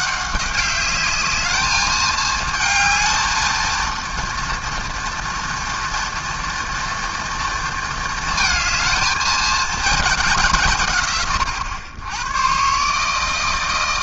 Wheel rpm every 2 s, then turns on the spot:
200, 220, 230, 230, 220, 150, 130.
none